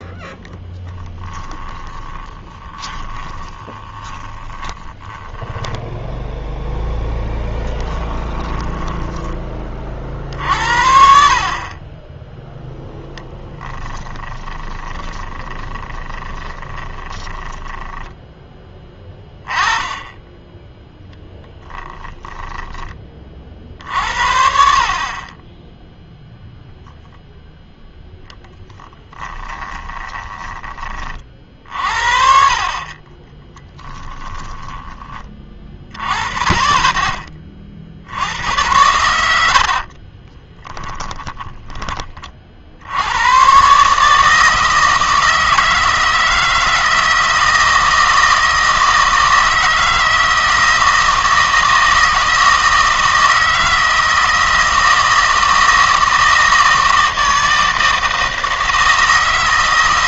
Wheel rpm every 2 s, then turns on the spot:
10, 20, 10, 10, 10, 60, 0, 20, 20, 10, 10, 20, 50, 0, 10, 20, 50, 10, 20, 90, 10, 60, 160, 160, 160, 160, 160, 160, 160, 160.
0-6 8-10 14-18 34-36 40-42